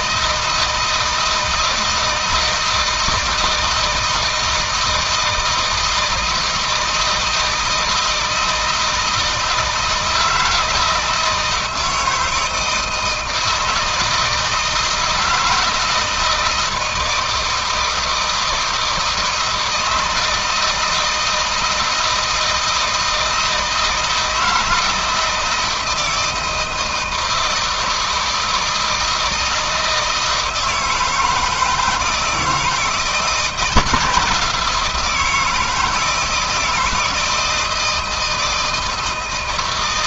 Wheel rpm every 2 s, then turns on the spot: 160, 160, 160, 160, 160, 160, 160, 160, 160, 160, 160, 160, 160, 160, 160, 160, 170, 170, 160, 160.
none